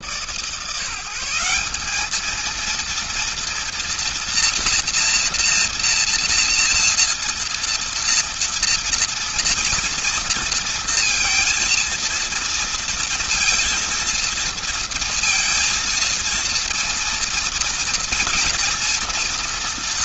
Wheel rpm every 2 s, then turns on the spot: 180, 230, 230, 230, 230, 230, 230, 230, 230, 230.
none